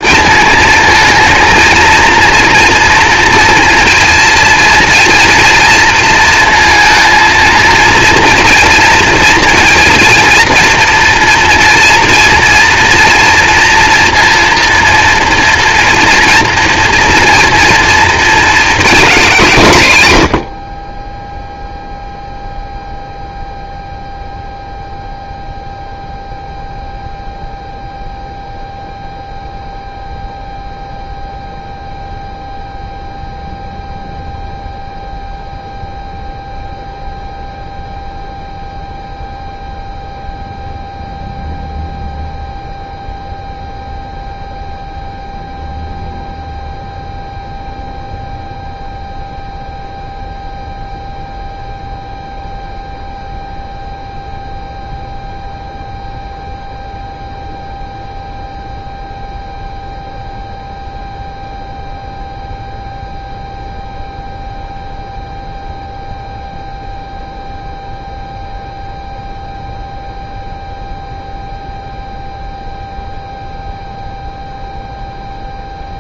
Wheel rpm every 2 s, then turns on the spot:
220, 230, 230, 230, 230, 230, 240, 230, 230, 220, 20, 0, 0, 0, 0, 0, 0, 0, 0, 0, 0, 0, 0, 0, 0, 0, 0, 0, 0, 0, 0, 0, 0, 0, 0, 0, 0, 0.
none